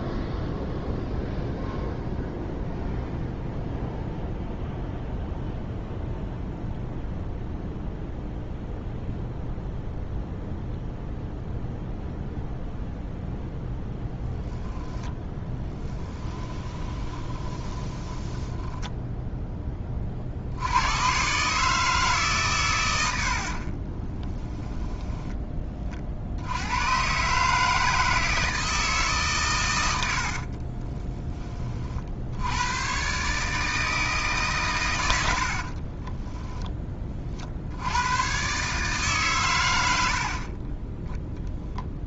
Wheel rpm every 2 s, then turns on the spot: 0, 0, 0, 0, 0, 0, 0, 10, 20, 10, 80, 130, 10, 90, 160, 40, 100, 130, 10, 120, 60.
16-18 24-26 30-32